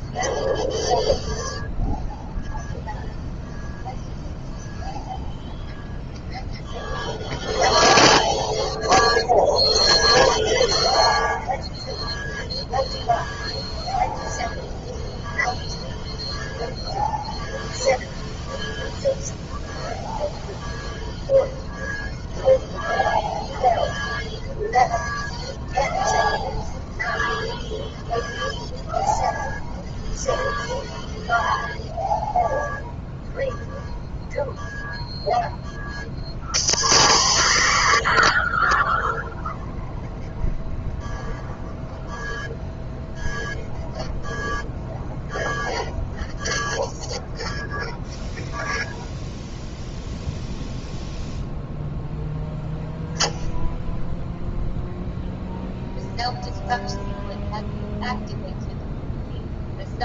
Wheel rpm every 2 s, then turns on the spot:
0, 0, 0, 0, 0, 0, 0, 0, 0, 0, 0, 0, 0, 0, 0, 0, 0, 0, 0, 0, 0, 0, 0, 0, 0, 0, 0, 0, 0, 0.
none